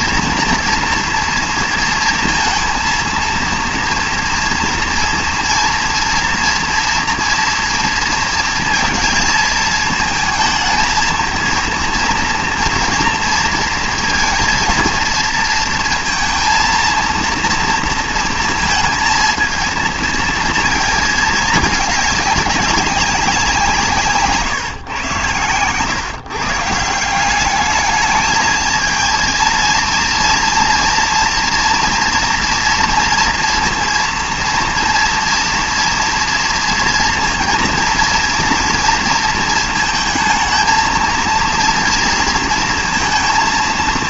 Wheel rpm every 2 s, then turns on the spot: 230, 230, 240, 230, 230, 220, 240, 230, 230, 220, 220, 200, 150, 150, 220, 240, 230, 230, 230, 230, 220, 230.
none